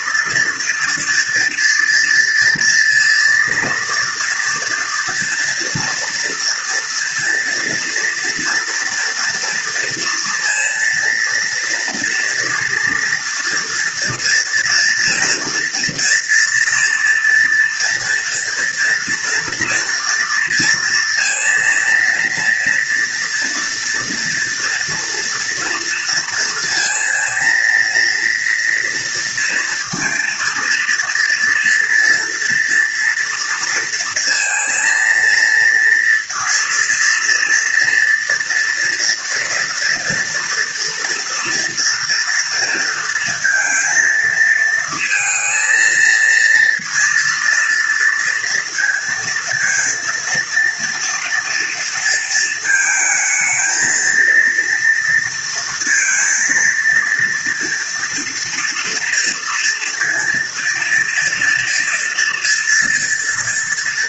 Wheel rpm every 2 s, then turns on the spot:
230, 230, 230, 230, 230, 230, 230, 230, 240, 230, 230, 230, 230, 230, 230, 230, 230, 230, 230, 240, 230, 230, 220, 230, 230, 230, 220, 230, 230, 230, 230, 230.
none